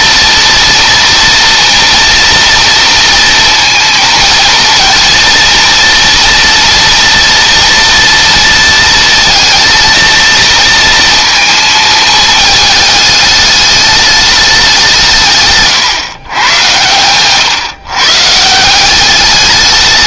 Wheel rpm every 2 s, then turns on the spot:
240, 230, 230, 230, 230, 230, 210, 180, 110, 190.
16-18